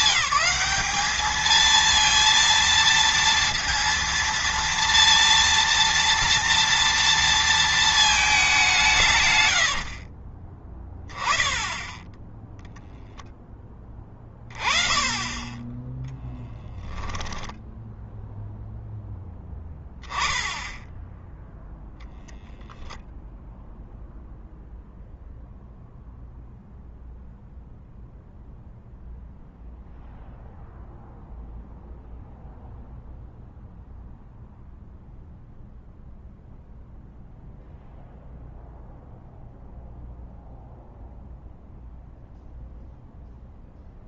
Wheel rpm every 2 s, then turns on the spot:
200, 230, 230, 230, 180, 20, 0, 20, 10, 0, 10, 0, 0, 0, 0, 0, 0, 0, 0, 0, 0, 0.
16-18